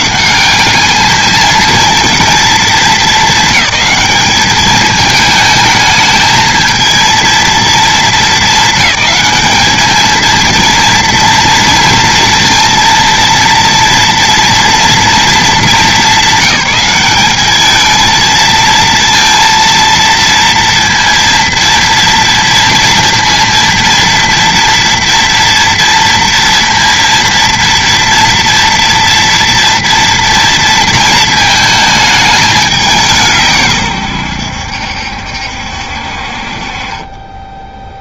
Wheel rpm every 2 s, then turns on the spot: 160, 220, 220, 220, 220, 220, 230, 230, 220, 220, 230, 230, 230, 230, 230, 230, 220, 120, 60.
none